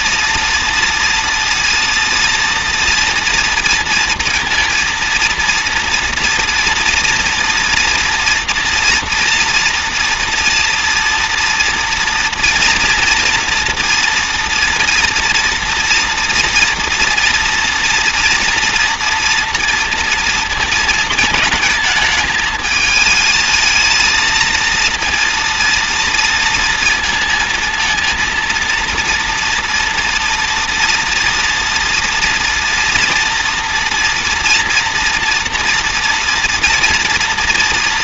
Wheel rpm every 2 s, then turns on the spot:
230, 240, 230, 230, 230, 230, 230, 230, 230, 230, 230, 220, 230, 230, 230, 240, 240, 230, 230.
none